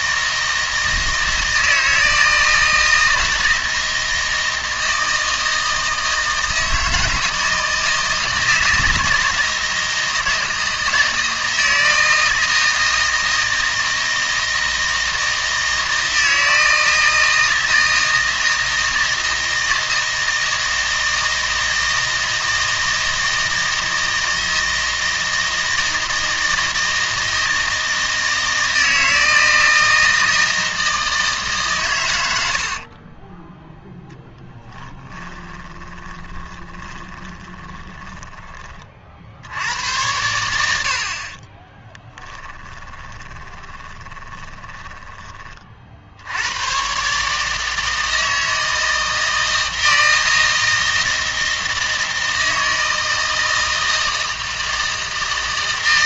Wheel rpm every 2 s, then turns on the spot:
160, 160, 160, 160, 160, 160, 160, 160, 160, 160, 160, 160, 160, 160, 160, 160, 60, 10, 20, 50, 70, 10, 20, 120, 160, 160, 160, 160.
32-34 36-38 42-46